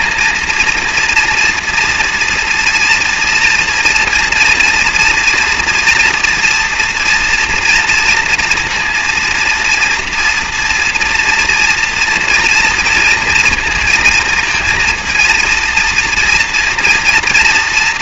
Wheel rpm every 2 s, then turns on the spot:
230, 230, 230, 240, 230, 230, 230, 230, 240.
none